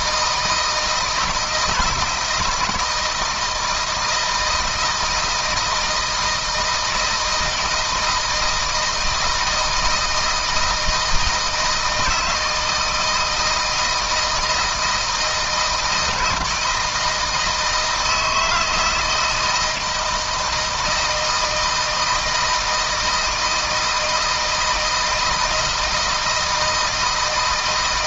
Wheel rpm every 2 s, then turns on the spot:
160, 160, 160, 170, 160, 160, 160, 160, 160, 160, 160, 160, 160, 160.
none